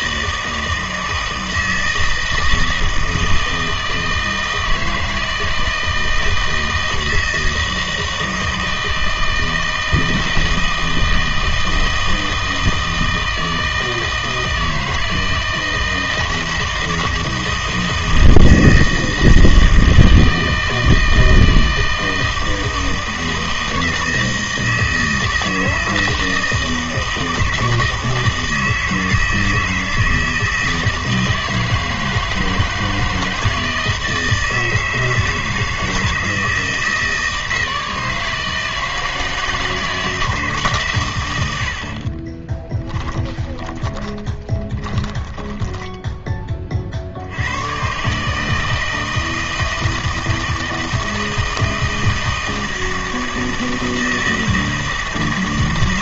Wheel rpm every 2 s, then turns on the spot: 160, 160, 160, 160, 160, 160, 160, 160, 160, 160, 160, 160, 160, 160, 160, 160, 160, 160, 160, 160, 140, 20, 20, 50, 160, 160, 160, 160.
42-46